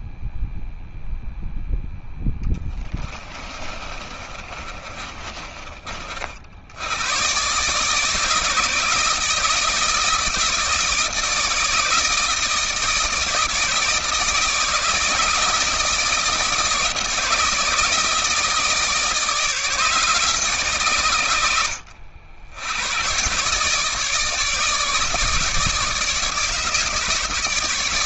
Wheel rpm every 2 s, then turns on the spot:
0, 20, 30, 110, 160, 160, 160, 160, 160, 150, 120, 120, 150, 150.
2-6